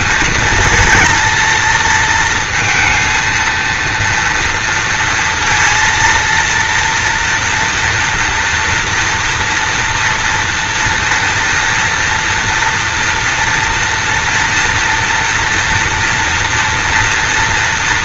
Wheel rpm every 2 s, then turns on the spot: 230, 230, 230, 230, 230, 230, 240, 230, 230.
none